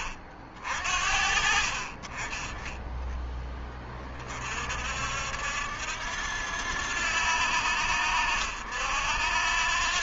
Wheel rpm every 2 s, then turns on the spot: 50, 10, 50, 80, 70.
none